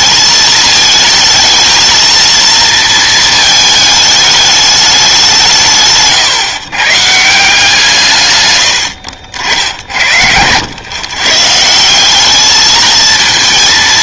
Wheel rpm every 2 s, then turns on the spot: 220, 230, 210, 140, 100, 110, 220.
none